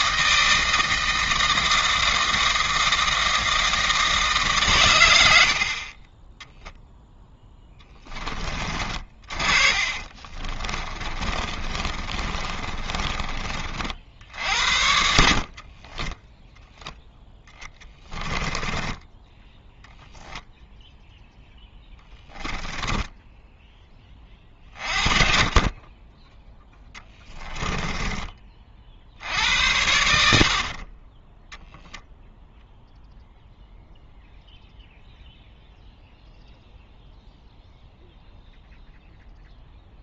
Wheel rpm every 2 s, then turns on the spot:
160, 160, 110, 10, 40, 20, 30, 60, 0, 10, 0, 10, 30, 10, 50, 30, 0, 0, 0, 0.
8-14 22-24 26-28